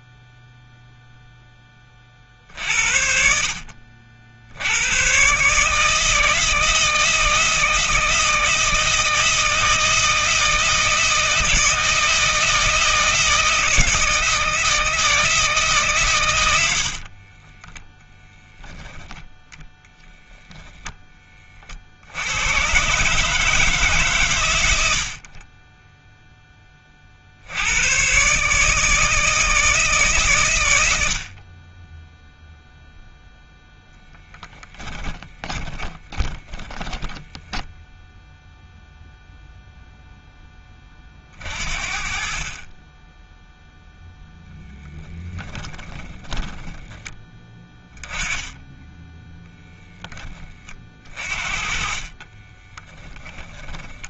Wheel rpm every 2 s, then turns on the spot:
0, 60, 70, 160, 160, 160, 160, 160, 80, 10, 0, 110, 110, 10, 150, 90, 0, 20, 30, 0, 10, 30, 0, 10, 20, 30, 20.
34-38 46-48 52-54